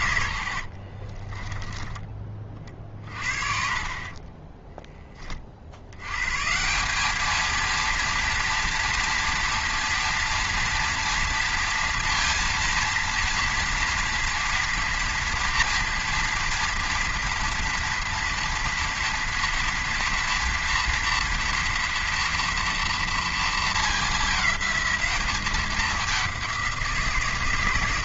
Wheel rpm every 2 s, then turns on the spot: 60, 40, 10, 170, 230, 230, 230, 240, 230, 230, 230, 240, 200, 180.
0-2 4-6